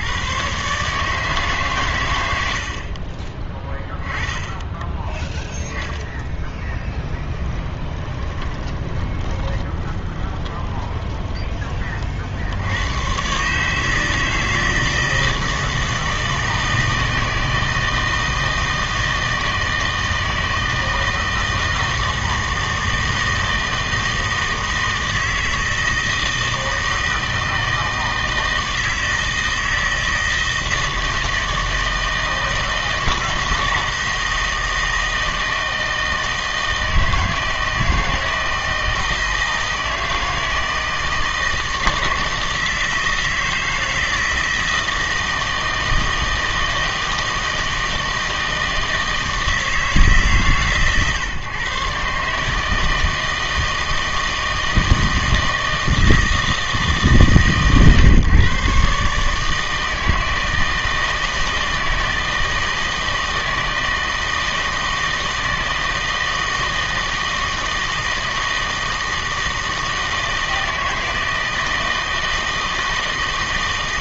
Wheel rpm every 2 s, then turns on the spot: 130, 60, 10, 10, 20, 20, 80, 160, 160, 160, 160, 160, 160, 160, 160, 160, 160, 160, 160, 160, 160, 160, 160, 160, 160, 130, 160, 160, 160, 140, 160, 160, 160, 160, 160, 160, 160.
6-12